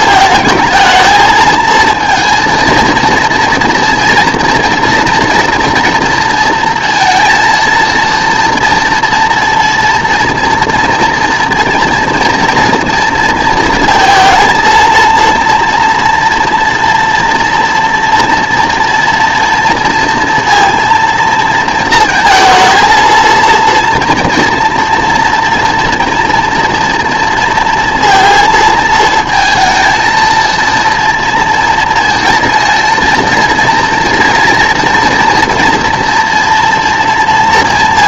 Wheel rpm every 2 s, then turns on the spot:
220, 230, 230, 230, 230, 230, 230, 230, 230, 230, 230, 230, 230, 230, 220, 230, 230, 230, 230.
none